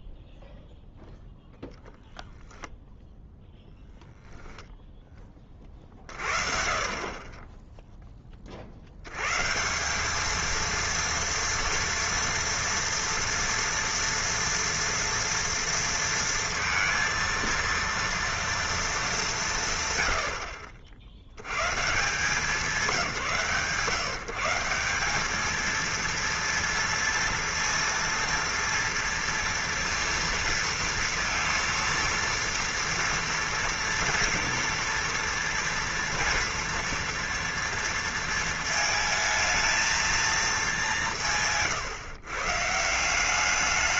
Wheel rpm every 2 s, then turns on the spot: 0, 0, 0, 60, 40, 230, 230, 230, 230, 230, 70, 180, 160, 230, 230, 230, 230, 230, 230, 220, 220, 140.
none